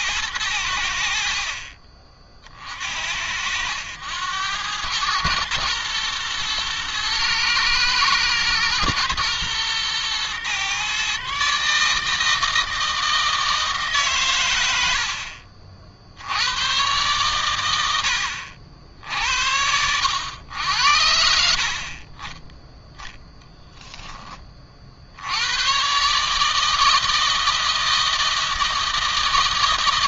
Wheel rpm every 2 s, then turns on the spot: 90, 50, 100, 120, 110, 120, 160, 100, 90, 70, 80, 10, 30, 150, 160.
none